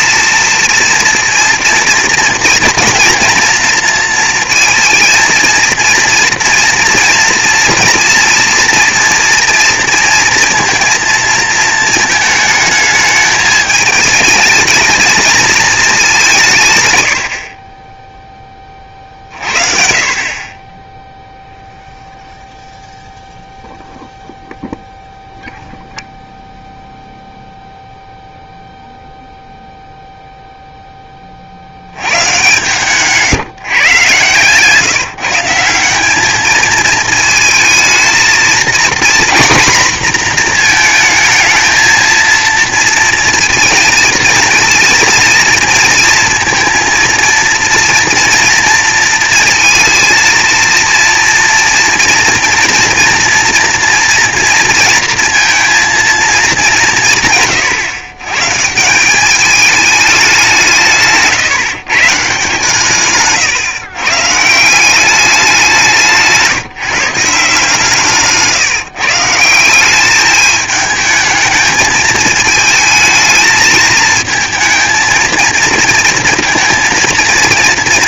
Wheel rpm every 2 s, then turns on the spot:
230, 230, 220, 230, 240, 230, 220, 220, 130, 20, 20, 0, 0, 0, 0, 0, 140, 140, 220, 240, 230, 230, 230, 230, 230, 240, 230, 230, 200, 160, 190, 150, 170, 160, 160, 210, 220, 220, 230.
none